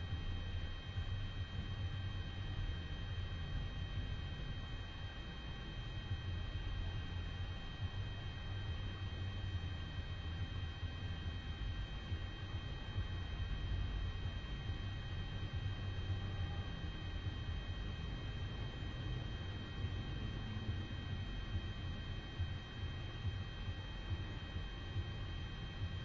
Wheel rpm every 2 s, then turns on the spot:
0, 0, 0, 0, 0, 0, 0, 0, 0, 0, 0, 0, 0.
none